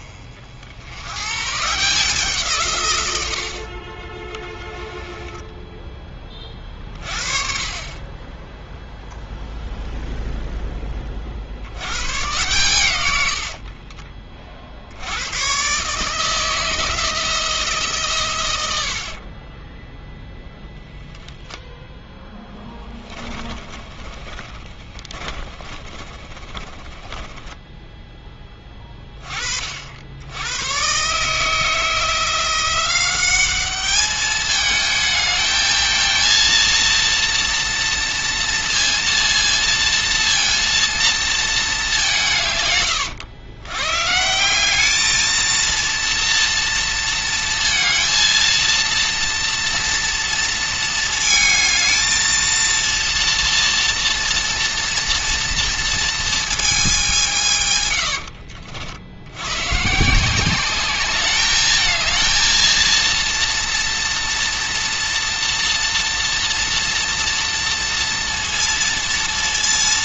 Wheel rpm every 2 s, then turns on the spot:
60, 140, 10, 30, 0, 10, 120, 40, 160, 90, 0, 10, 20, 30, 20, 110, 180, 220, 230, 230, 230, 130, 200, 230, 230, 230, 230, 240, 220, 60, 190, 230, 230, 230, 230.
4-6 22-28